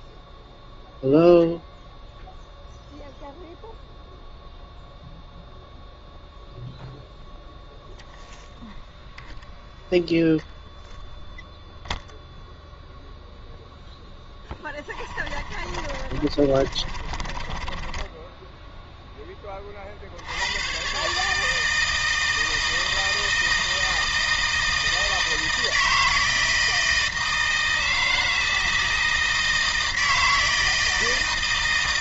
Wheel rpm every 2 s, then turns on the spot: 0, 0, 0, 0, 0, 0, 0, 20, 40, 0, 110, 160, 160, 160, 160, 160.
14-18